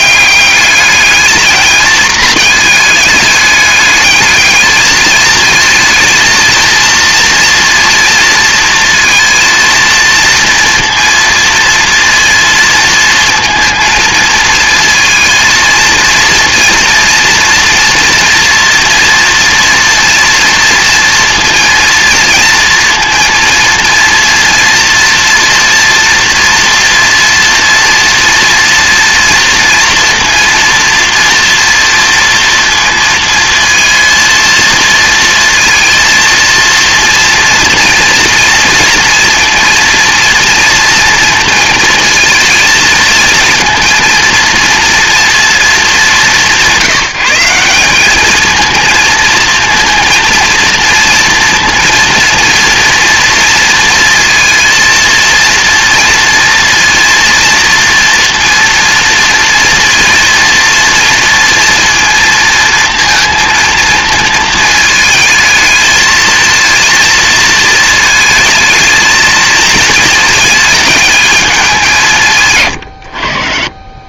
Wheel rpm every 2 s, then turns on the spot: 210, 210, 220, 230, 230, 230, 230, 230, 230, 240, 230, 230, 230, 240, 230, 230, 230, 230, 230, 230, 230, 230, 230, 180, 230, 230, 240, 230, 230, 230, 230, 230, 220, 230, 220, 210, 110.
72-74